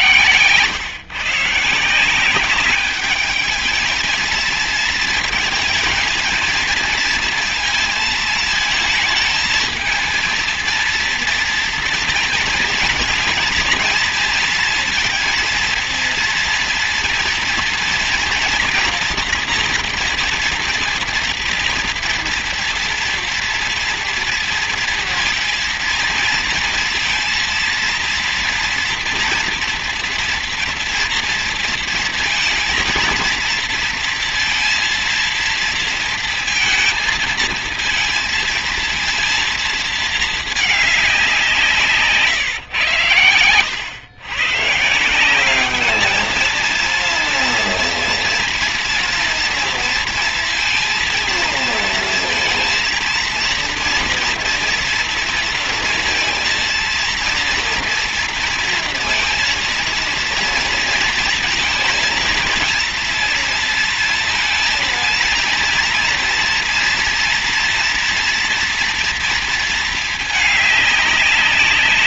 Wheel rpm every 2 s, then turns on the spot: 140, 200, 230, 230, 220, 230, 220, 230, 230, 240, 240, 230, 230, 230, 230, 240, 230, 230, 230, 230, 210, 140, 140, 230, 230, 230, 230, 230, 230, 230, 230, 230, 230, 230, 240, 210.
none